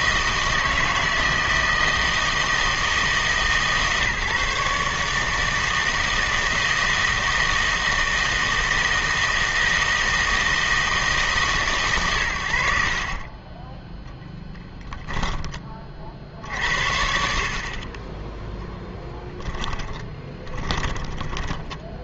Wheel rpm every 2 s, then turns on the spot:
160, 160, 140, 160, 160, 160, 70, 10, 60, 10, 20.
14-16 20-22